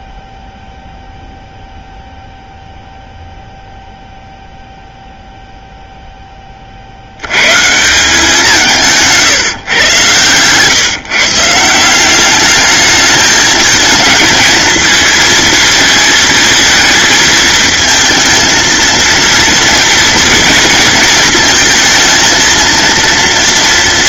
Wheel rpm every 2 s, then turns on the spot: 0, 0, 0, 60, 170, 140, 210, 220, 220, 230, 230, 230.
none